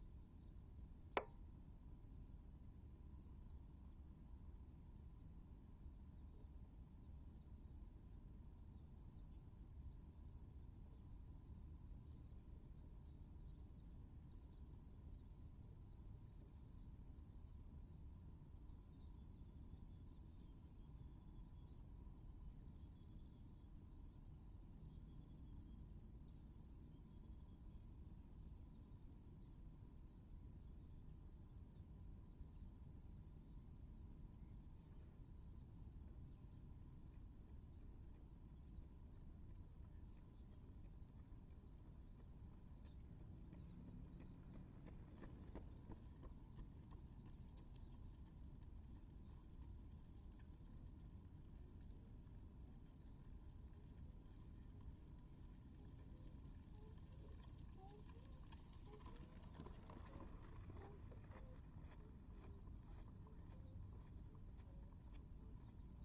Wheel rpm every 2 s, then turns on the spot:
0, 0, 0, 0, 0, 0, 0, 0, 0, 0, 0, 0, 0, 0, 0, 0, 0, 0, 0, 0, 0, 0, 0, 0, 0, 0, 0, 0, 0, 0, 0, 0, 0.
none